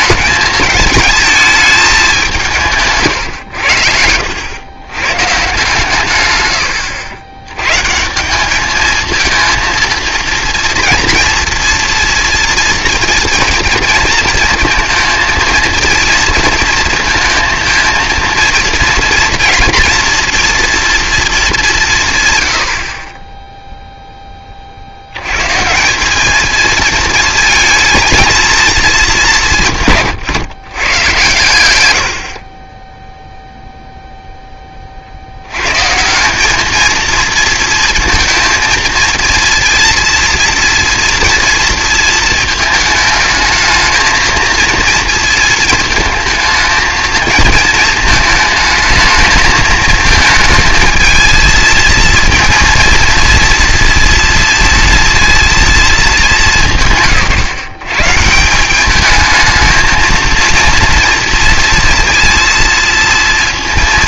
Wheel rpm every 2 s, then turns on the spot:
210, 170, 100, 100, 200, 230, 230, 230, 230, 230, 230, 90, 50, 220, 220, 130, 30, 20, 210, 230, 230, 220, 230, 220, 220, 220, 230, 230, 170, 190, 230, 230.
none